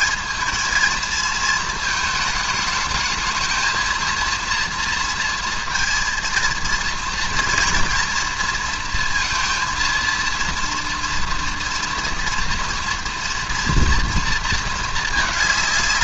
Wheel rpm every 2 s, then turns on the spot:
220, 220, 230, 230, 230, 230, 230, 220.
none